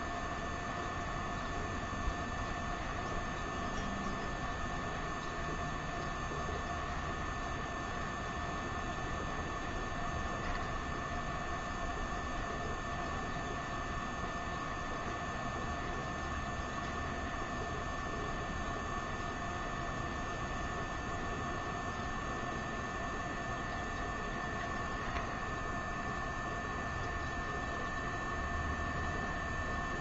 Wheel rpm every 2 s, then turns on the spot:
0, 0, 0, 0, 0, 0, 0, 0, 0, 0, 0, 0, 0, 0, 0.
none